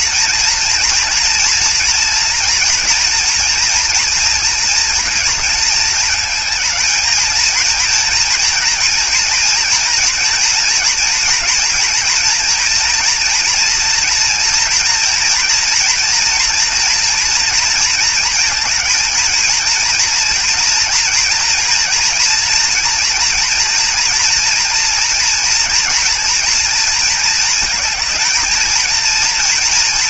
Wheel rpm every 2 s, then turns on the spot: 230, 230, 230, 220, 240, 240, 230, 230, 230, 220, 230, 230, 240, 230, 230.
none